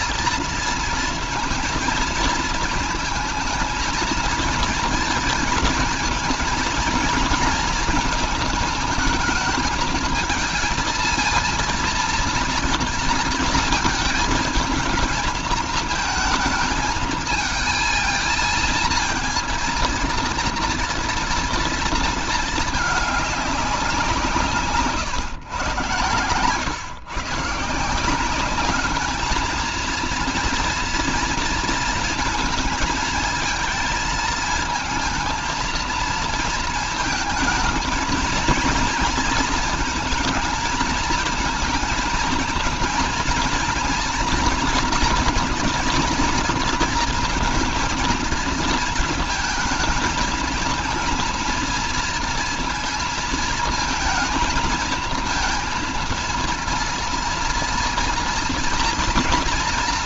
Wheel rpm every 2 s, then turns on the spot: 230, 230, 230, 230, 220, 220, 230, 220, 220, 230, 230, 210, 140, 120, 200, 240, 220, 230, 220, 230, 220, 230, 230, 230, 230, 230, 230, 230, 230, 230.
none